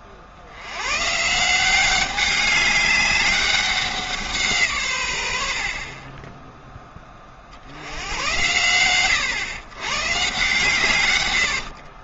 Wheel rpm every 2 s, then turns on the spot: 100, 200, 140, 10, 110, 150.
none